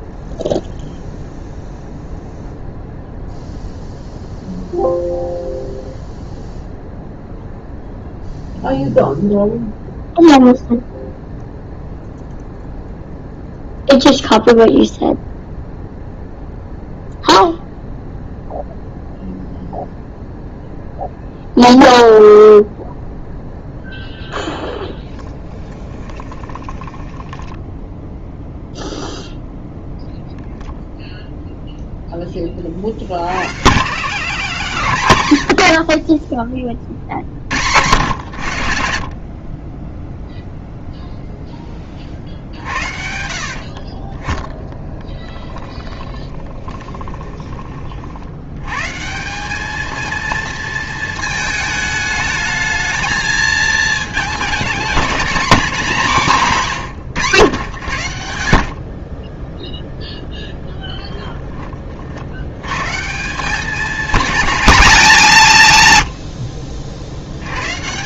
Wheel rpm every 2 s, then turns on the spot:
0, 0, 0, 0, 0, 0, 0, 0, 0, 0, 0, 0, 10, 20, 0, 0, 30, 130, 30, 70, 0, 60, 10, 20, 120, 230, 220, 220, 160, 60, 10, 120, 210, 60.
24-28 44-48